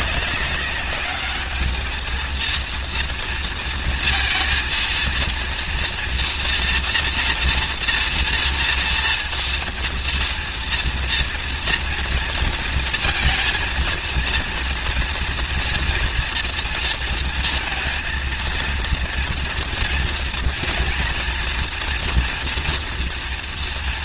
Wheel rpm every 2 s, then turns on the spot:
200, 230, 230, 240, 240, 240, 230, 230, 230, 230, 230, 230.
none